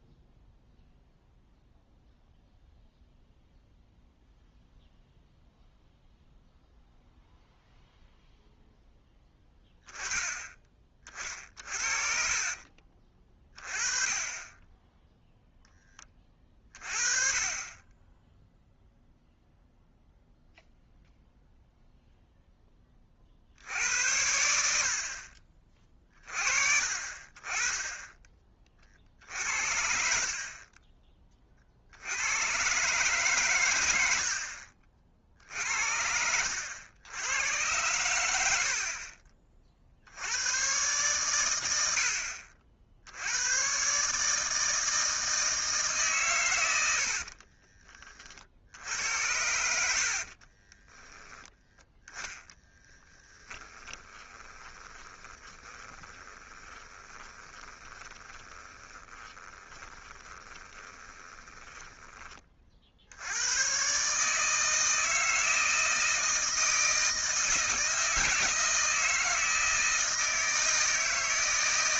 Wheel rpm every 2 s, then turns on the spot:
0, 0, 0, 0, 0, 20, 40, 10, 30, 0, 0, 20, 60, 40, 40, 30, 130, 50, 90, 60, 120, 70, 160, 100, 70, 20, 10, 20, 20, 20, 20, 50, 160, 160, 160, 160.
12-14 50-62